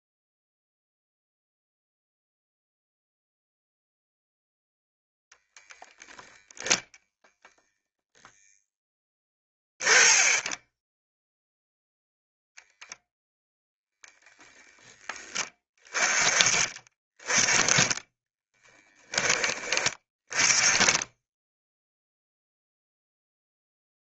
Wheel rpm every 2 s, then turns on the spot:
0, 0, 0, 0, 10, 10, 0, 10, 20, 10, 10, 0.
8-12